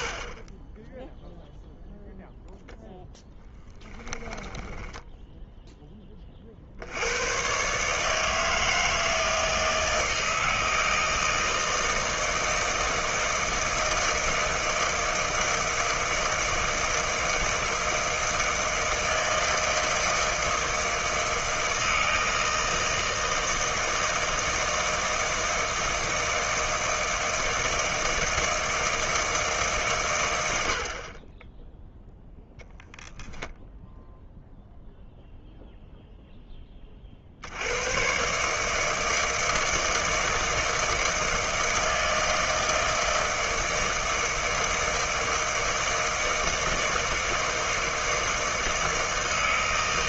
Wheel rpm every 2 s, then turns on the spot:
20, 0, 20, 50, 160, 160, 160, 160, 160, 160, 160, 160, 160, 160, 160, 70, 0, 0, 20, 150, 160, 160, 160, 160, 160.
4-6